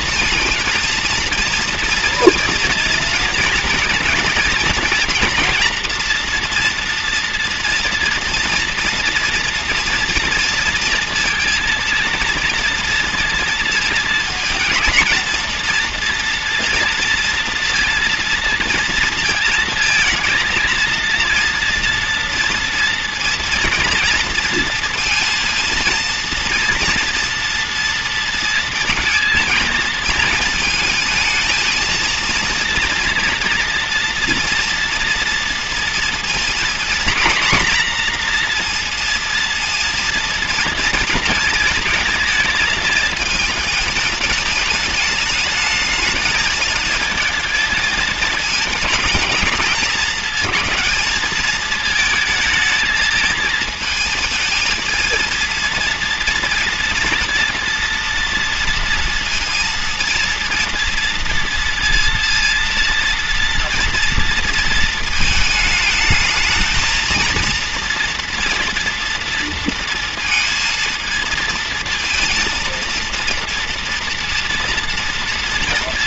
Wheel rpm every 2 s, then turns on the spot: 230, 230, 230, 230, 230, 230, 230, 230, 230, 230, 230, 230, 230, 230, 230, 220, 230, 230, 230, 240, 230, 220, 220, 220, 220, 220, 220, 220, 230, 230, 240, 230, 230, 220, 230, 230, 230, 230.
none